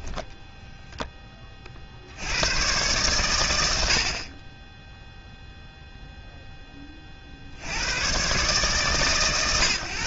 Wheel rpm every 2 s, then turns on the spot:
40, 90, 0, 70, 110.
none